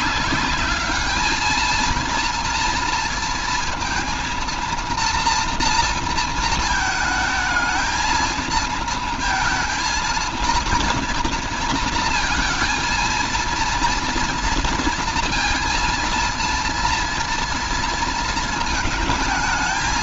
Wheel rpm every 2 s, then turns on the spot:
210, 230, 230, 220, 220, 230, 230, 230, 230, 230.
none